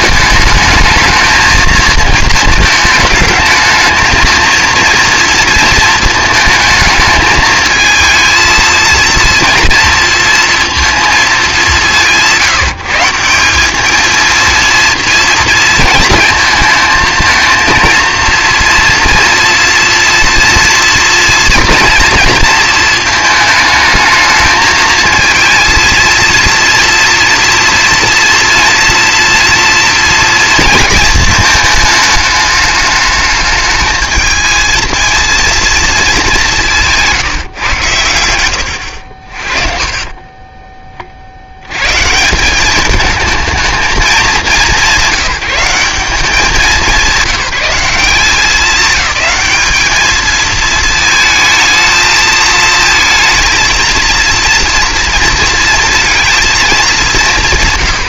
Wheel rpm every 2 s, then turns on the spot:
210, 220, 230, 220, 230, 230, 170, 230, 220, 230, 230, 230, 220, 230, 240, 230, 210, 220, 180, 90, 20, 200, 200, 200, 200, 220, 230, 230, 220.
none